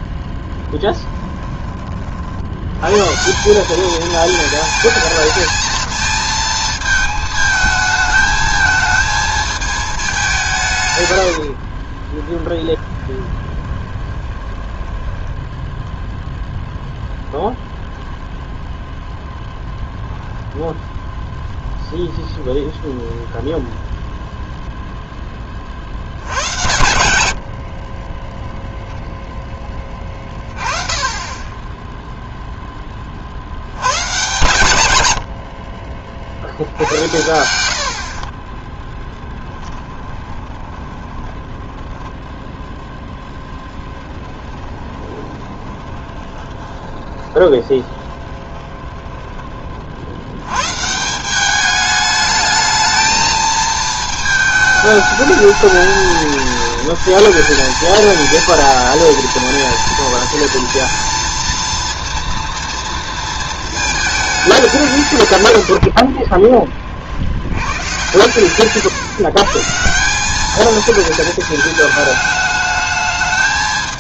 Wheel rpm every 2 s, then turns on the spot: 10, 90, 220, 220, 220, 170, 20, 10, 0, 0, 0, 0, 0, 90, 0, 20, 10, 130, 70, 20, 20, 0, 10, 20, 20, 120, 210, 220, 230, 230, 230, 230, 190, 30, 130, 220, 210.
0-2 12-16 36-42 44-50